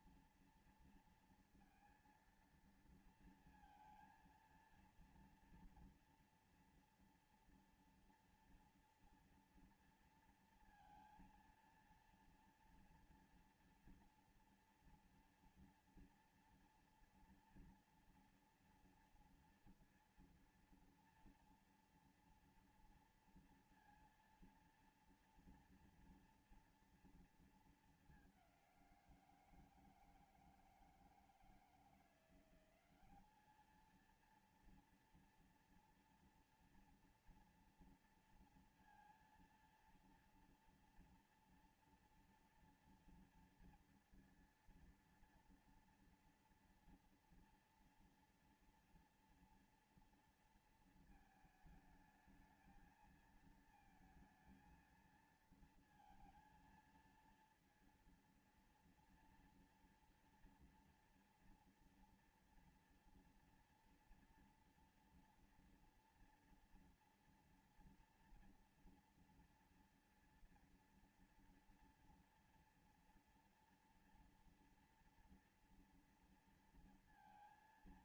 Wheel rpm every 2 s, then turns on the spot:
230, 230, 230, 230, 230, 230, 230, 230, 230, 230, 230, 230, 230, 230, 170, 160, 200, 230, 230, 230, 240, 230, 230, 230, 230, 220, 220, 230, 230, 230, 230, 240, 230, 230, 230, 240, 240, 230, 230.
none